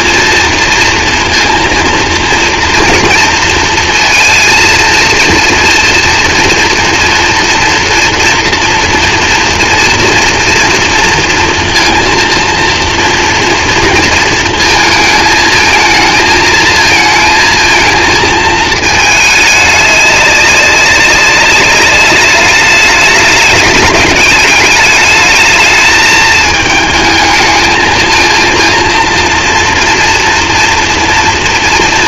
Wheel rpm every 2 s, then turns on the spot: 230, 230, 230, 230, 230, 230, 230, 220, 220, 220, 200, 210, 200, 220, 230, 230.
none